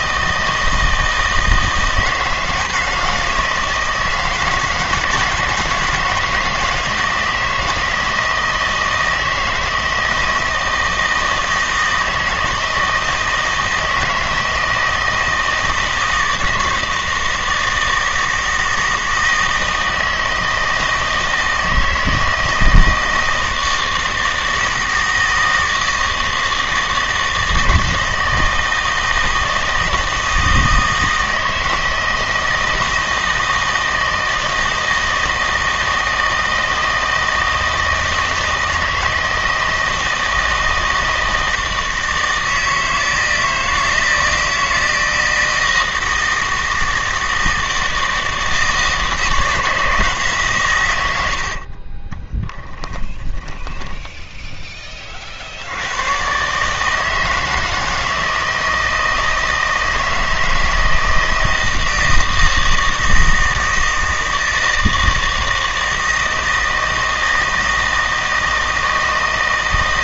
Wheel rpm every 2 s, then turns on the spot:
160, 160, 160, 160, 160, 160, 160, 160, 160, 160, 160, 160, 160, 160, 160, 160, 160, 160, 160, 160, 160, 160, 160, 160, 160, 130, 20, 10, 140, 160, 160, 160, 160, 160, 160.
52-54